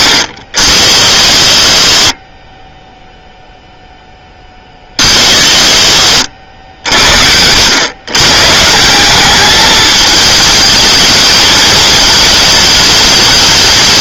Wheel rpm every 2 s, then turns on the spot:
70, 10, 30, 70, 160, 220, 220.
none